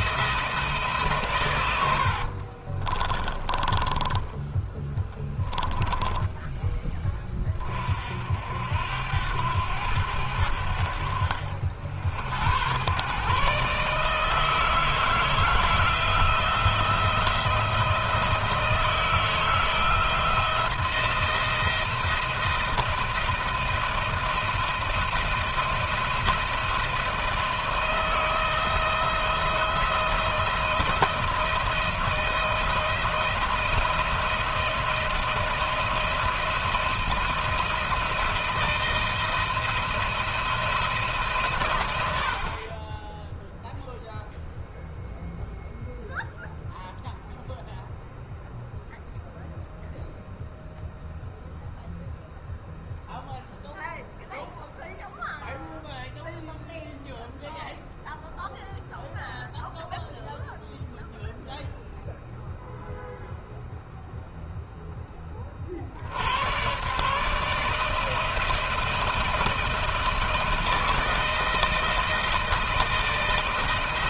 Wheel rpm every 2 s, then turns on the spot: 160, 40, 20, 10, 70, 80, 90, 160, 170, 160, 160, 170, 170, 170, 160, 170, 170, 170, 170, 170, 170, 50, 0, 0, 0, 0, 0, 0, 0, 0, 0, 0, 0, 110, 160, 160, 160.
2-6